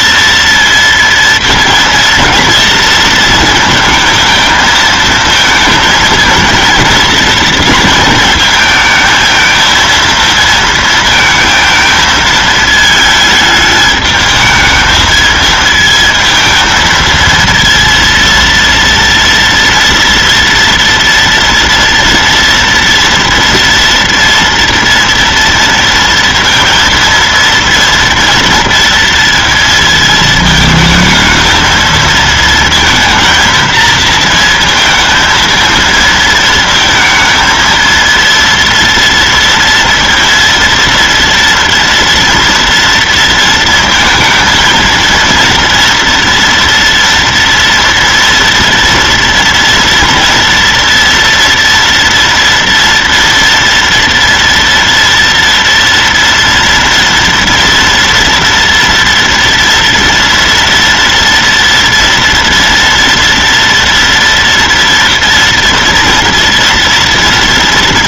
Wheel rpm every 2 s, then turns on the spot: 230, 230, 230, 220, 230, 230, 220, 210, 220, 230, 230, 230, 230, 230, 230, 220, 220, 230, 230, 230, 230, 230, 230, 230, 230, 230, 230, 230, 230, 230, 230, 230, 230, 240.
none